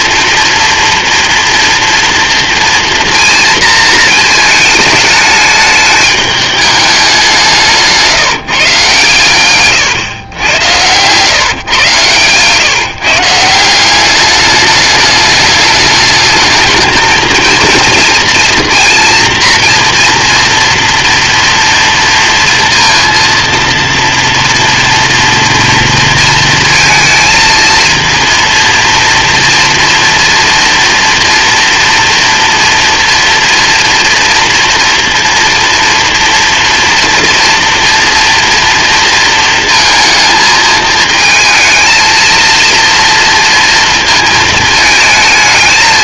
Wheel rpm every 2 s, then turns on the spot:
230, 230, 220, 210, 150, 110, 140, 210, 220, 230, 230, 230, 240, 230, 230, 230, 230, 230, 240, 230, 220, 230, 220.
10-12